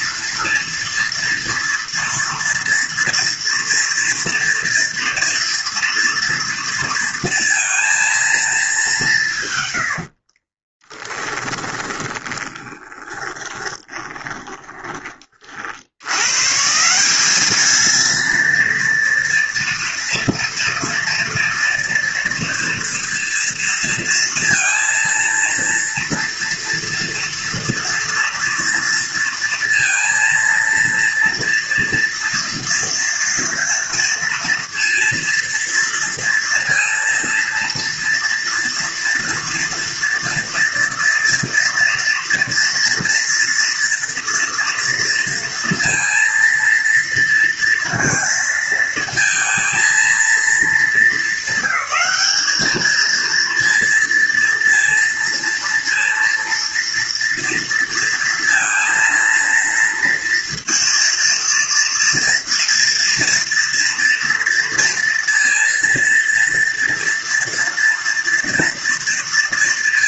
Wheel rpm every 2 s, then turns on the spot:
240, 230, 230, 230, 210, 20, 20, 20, 150, 230, 240, 230, 230, 230, 230, 230, 230, 230, 230, 230, 230, 240, 230, 230, 230, 210, 210, 230, 230, 230, 230, 230, 230, 230, 230.
10-16